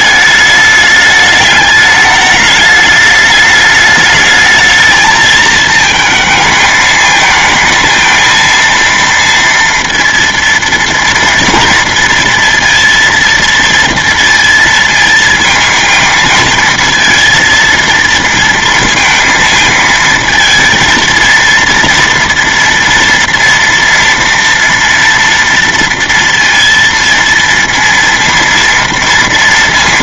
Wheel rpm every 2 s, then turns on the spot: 210, 210, 220, 220, 230, 230, 230, 230, 230, 230, 230, 230, 230, 230, 230.
none